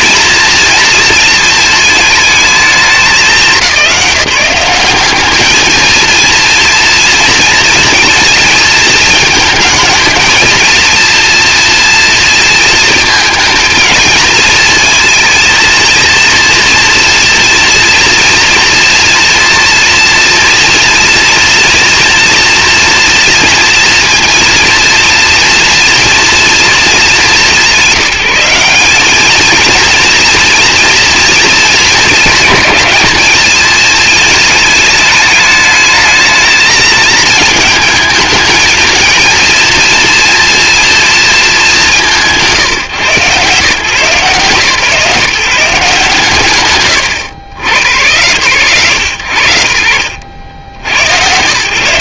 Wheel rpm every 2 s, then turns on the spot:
230, 220, 190, 230, 220, 230, 230, 230, 240, 230, 230, 230, 230, 230, 190, 230, 220, 220, 220, 220, 230, 140, 150, 140, 110, 90.
none